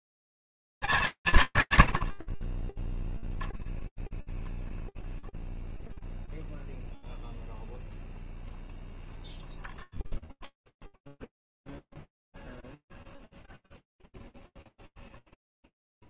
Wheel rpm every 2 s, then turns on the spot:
100, 50, 0, 0, 0, 0, 0, 0.
none